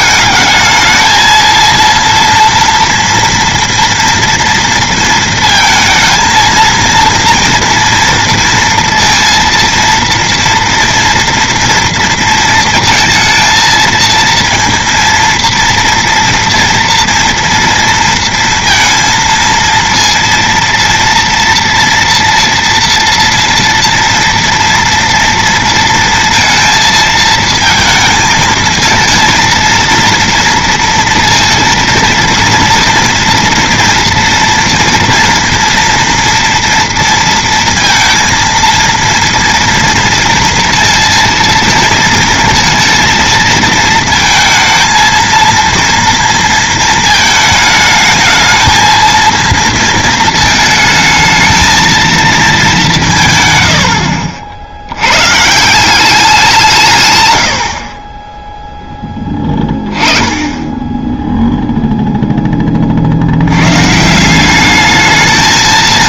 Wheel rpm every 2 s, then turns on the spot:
220, 230, 230, 230, 230, 230, 230, 230, 230, 230, 230, 240, 240, 230, 220, 230, 230, 230, 230, 230, 230, 230, 230, 230, 220, 220, 210, 80, 160, 10, 10, 30, 210.
none